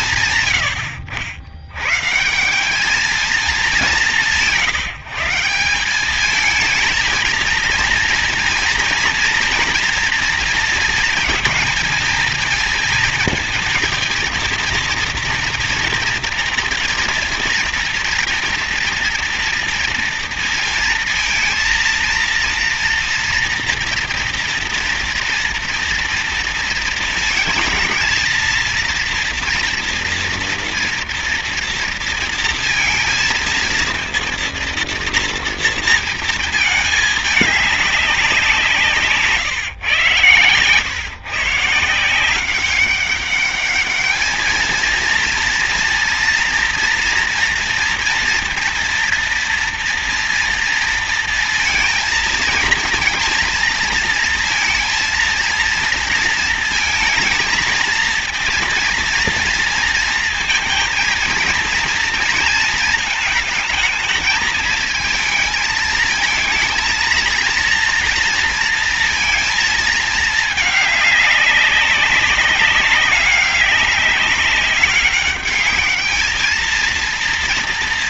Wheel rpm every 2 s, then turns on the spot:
110, 200, 170, 220, 230, 230, 230, 230, 230, 230, 230, 230, 240, 230, 230, 230, 230, 230, 220, 150, 130, 200, 230, 230, 230, 230, 230, 230, 230, 230, 230, 220, 220, 230, 230, 210, 200, 200, 230.
none